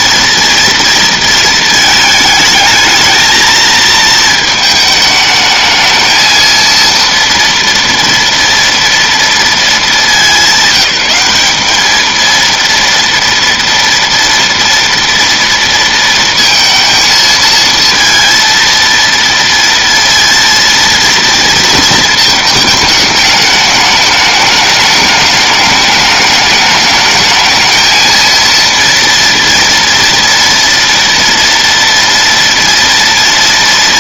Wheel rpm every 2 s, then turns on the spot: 230, 220, 220, 230, 230, 190, 230, 230, 220, 230, 230, 210, 210, 210, 230, 230, 240.
none